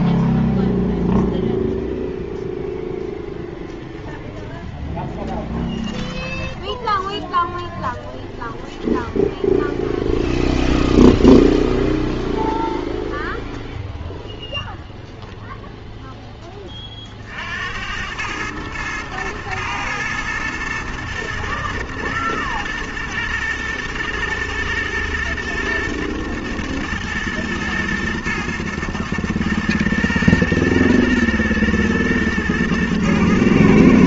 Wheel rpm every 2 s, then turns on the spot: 0, 0, 10, 10, 0, 0, 0, 0, 30, 110, 110, 110, 110, 110, 120, 110, 110.
6-8